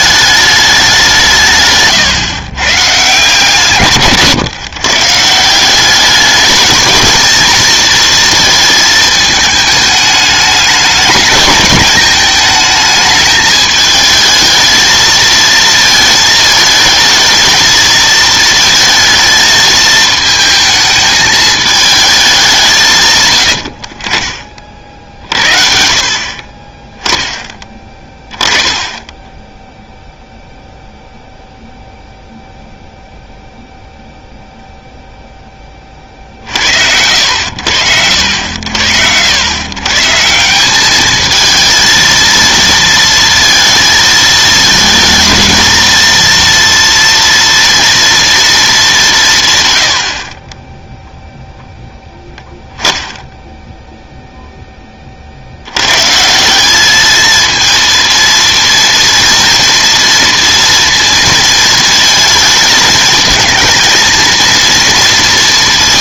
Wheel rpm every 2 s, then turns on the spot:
210, 120, 140, 220, 220, 210, 210, 220, 220, 220, 220, 160, 40, 20, 10, 0, 0, 0, 70, 80, 190, 230, 220, 230, 210, 10, 0, 10, 200, 230, 230, 220, 230.
26-28